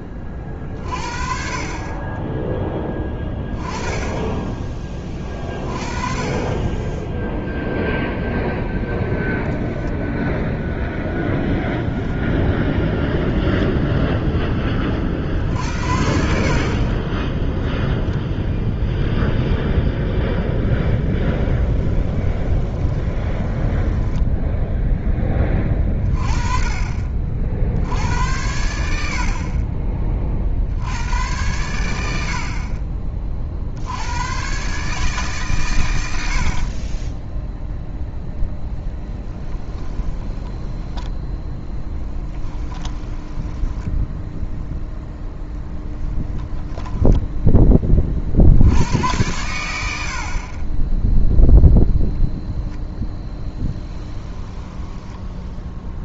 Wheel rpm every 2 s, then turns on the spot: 40, 10, 20, 10, 0, 0, 0, 20, 40, 0, 10, 20, 0, 30, 80, 70, 40, 140, 50, 10, 10, 10, 0, 10, 80, 20, 0, 10.
20-24 38-44 46-48 54-56